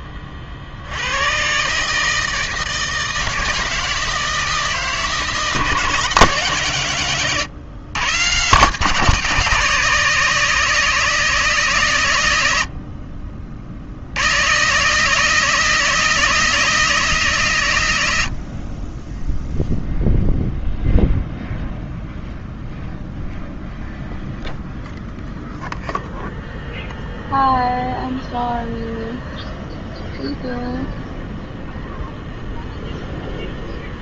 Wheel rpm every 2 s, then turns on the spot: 80, 160, 160, 120, 160, 160, 80, 140, 170, 30, 0, 0, 0, 0, 0, 0, 0.
none